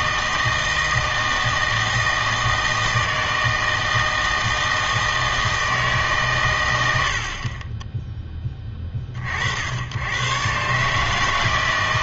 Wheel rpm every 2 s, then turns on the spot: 160, 160, 160, 110, 20, 130.
none